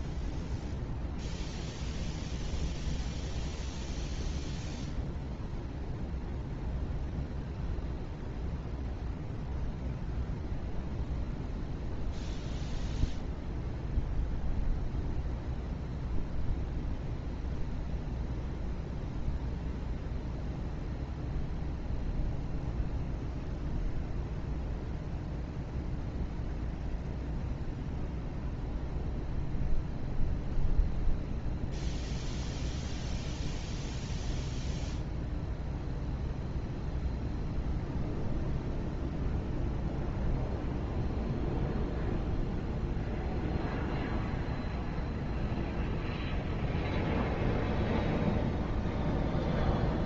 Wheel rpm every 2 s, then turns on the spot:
0, 0, 0, 0, 0, 0, 0, 0, 0, 0, 0, 0, 0, 0, 0, 0, 0, 0, 0, 0, 0, 0, 0, 0, 0.
none